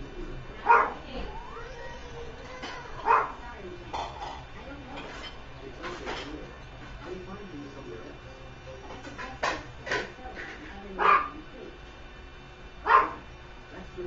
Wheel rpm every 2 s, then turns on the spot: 0, 0, 0, 0, 0, 0, 0.
none